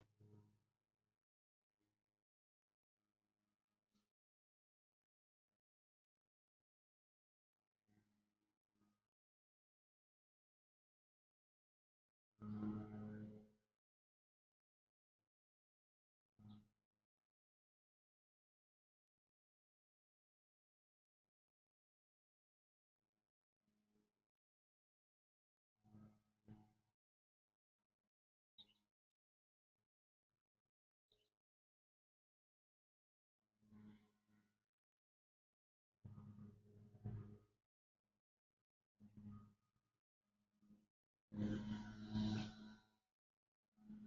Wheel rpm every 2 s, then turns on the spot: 0, 0, 0, 0, 0, 0, 0, 0, 0, 0, 0, 0, 0, 0, 0, 0, 0, 0, 0, 0, 0, 0.
none